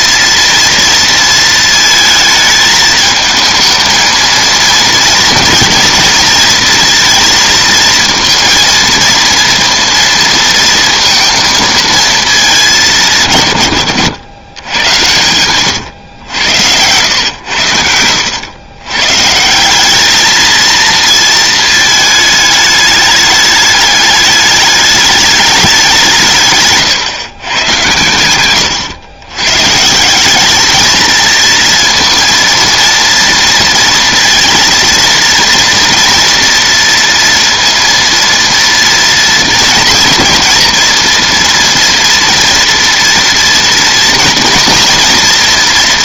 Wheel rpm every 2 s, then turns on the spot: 230, 220, 230, 230, 230, 230, 210, 100, 100, 100, 230, 210, 210, 150, 100, 220, 230, 230, 230, 230, 230, 230, 230.
28-30